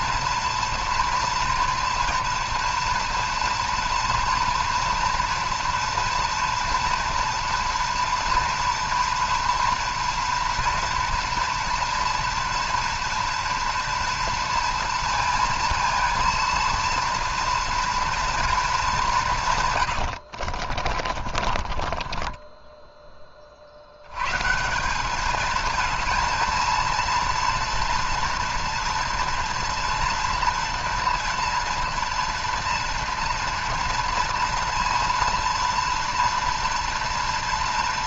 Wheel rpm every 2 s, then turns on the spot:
230, 230, 240, 240, 230, 230, 230, 230, 230, 220, 50, 10, 180, 230, 230, 240, 230, 230, 230.
20-24